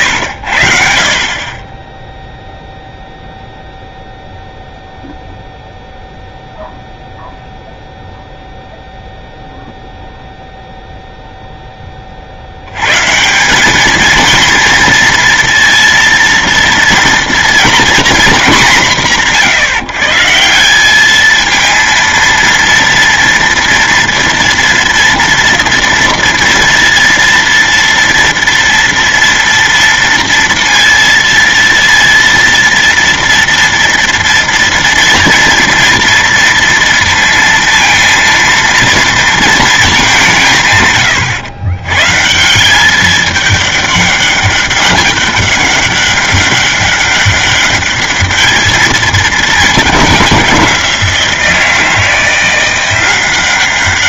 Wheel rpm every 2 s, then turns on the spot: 60, 0, 0, 0, 0, 0, 130, 230, 230, 190, 200, 230, 230, 230, 230, 230, 230, 230, 230, 230, 130, 200, 200, 200, 220, 180, 180.
none